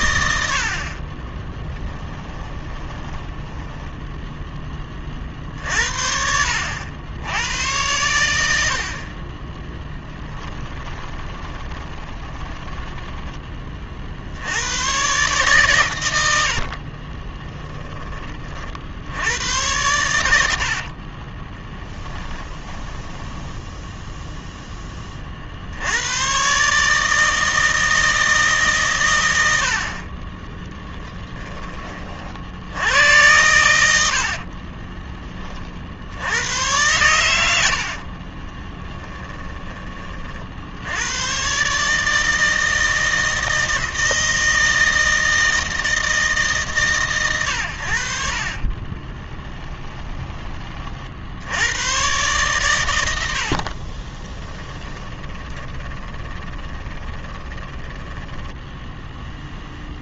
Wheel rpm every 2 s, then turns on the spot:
60, 20, 20, 70, 60, 20, 10, 110, 60, 60, 60, 10, 20, 150, 140, 20, 90, 30, 100, 20, 80, 160, 160, 140, 30, 40, 110, 10, 20, 10.
2-4 10-14 16-18 20-24 30-32 34-36 38-40 48-50 54-60